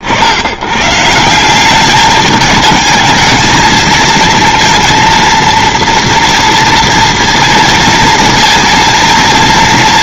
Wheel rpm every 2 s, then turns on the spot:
110, 220, 230, 230, 230.
none